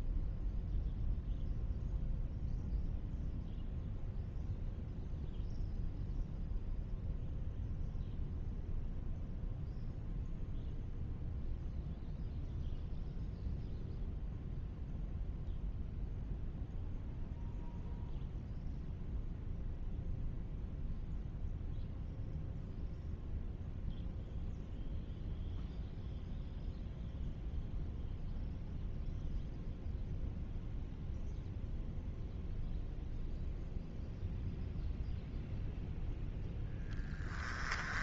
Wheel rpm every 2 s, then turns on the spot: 0, 0, 0, 0, 0, 0, 0, 0, 0, 0, 0, 0, 0, 0, 0, 0, 0, 0, 10.
none